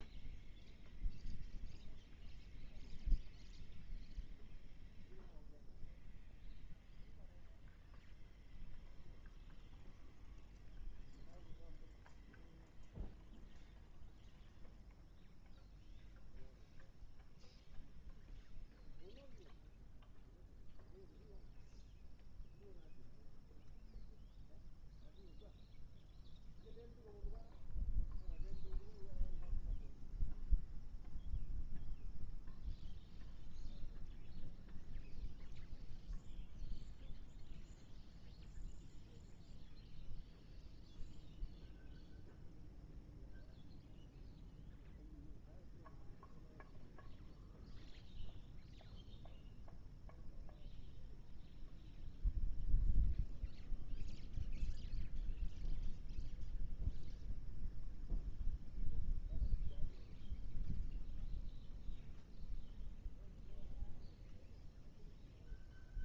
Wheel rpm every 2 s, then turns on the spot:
0, 0, 0, 0, 0, 0, 0, 0, 0, 0, 0, 0, 0, 0, 0, 0, 0, 0, 0, 0, 0, 0, 0, 0, 0, 0, 0, 0, 0, 0, 0, 0, 0.
none